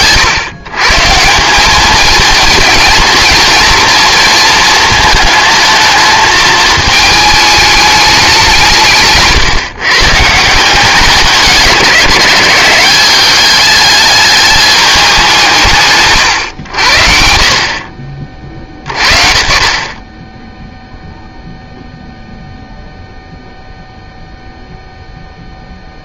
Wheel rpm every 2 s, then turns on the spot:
140, 230, 230, 220, 160, 190, 190, 210, 90, 60, 0, 0, 0.
none